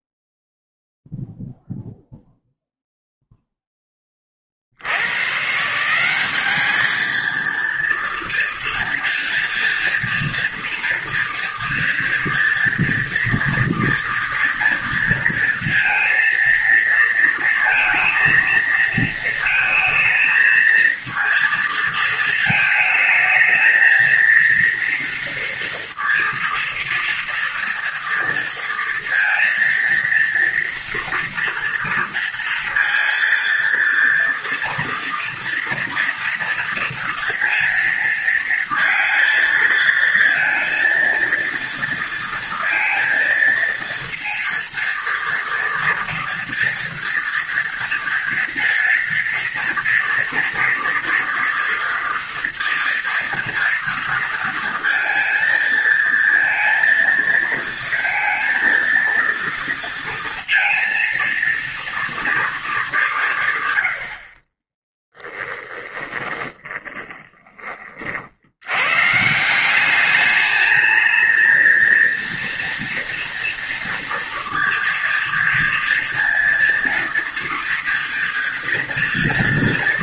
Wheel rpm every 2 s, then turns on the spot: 0, 0, 50, 200, 230, 240, 230, 230, 230, 230, 230, 220, 230, 230, 230, 230, 230, 230, 230, 230, 230, 230, 230, 230, 230, 230, 230, 230, 230, 230, 230, 220, 40, 20, 90, 210, 230, 230, 230, 230.
64-68